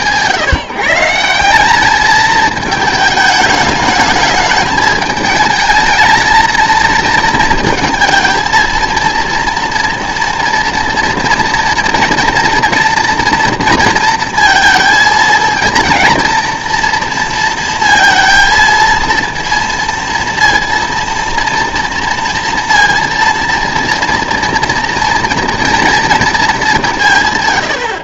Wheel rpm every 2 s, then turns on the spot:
160, 220, 210, 230, 230, 230, 230, 220, 230, 230, 230, 230, 230, 200.
none